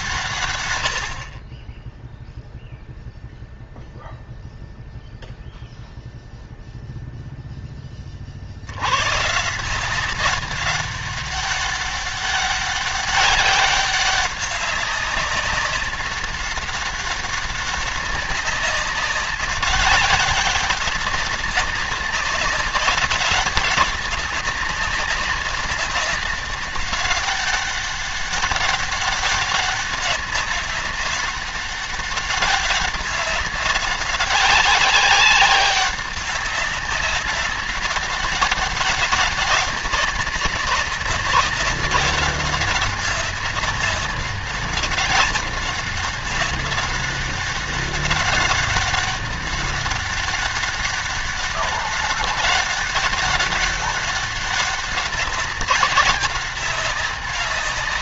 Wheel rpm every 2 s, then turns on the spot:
100, 0, 0, 0, 100, 200, 200, 190, 200, 200, 200, 190, 190, 200, 200, 190, 190, 190, 200, 200, 200, 200, 200, 190, 200, 200, 200, 200, 190.
none